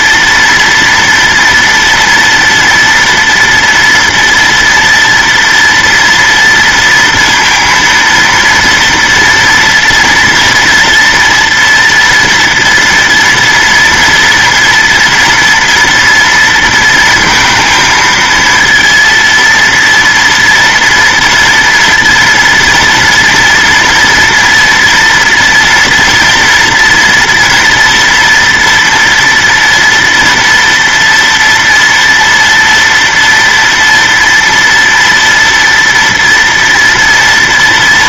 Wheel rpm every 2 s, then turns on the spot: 230, 240, 230, 230, 230, 230, 240, 240, 230, 230, 230, 230, 230, 230, 230, 230, 230, 230, 230.
none